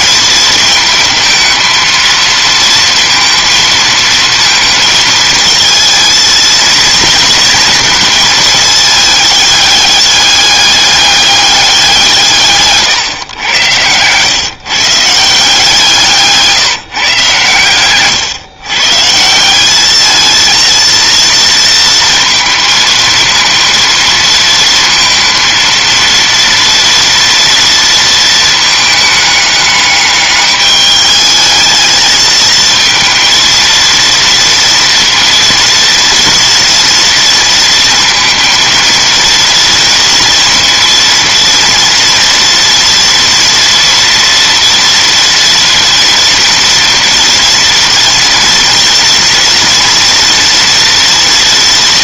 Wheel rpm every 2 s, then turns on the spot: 220, 230, 220, 230, 220, 200, 130, 150, 140, 140, 230, 220, 230, 230, 210, 210, 230, 230, 230, 230, 230, 230, 230, 230, 240, 230.
none